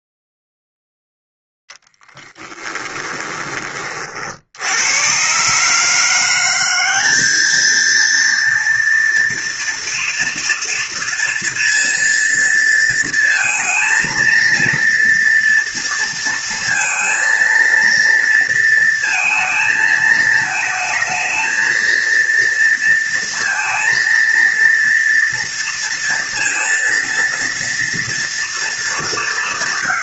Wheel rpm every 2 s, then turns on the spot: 0, 20, 70, 180, 230, 230, 230, 230, 230, 230, 220, 230, 230, 230, 230.
2-4